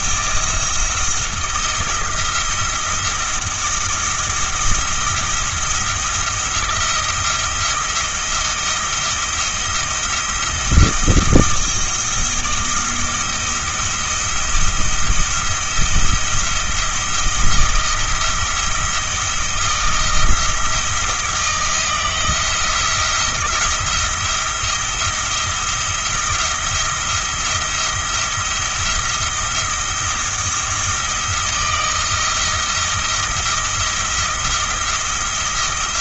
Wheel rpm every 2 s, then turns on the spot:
170, 170, 170, 170, 170, 170, 170, 170, 170, 170, 160, 170, 170, 170, 170, 170, 170, 170.
none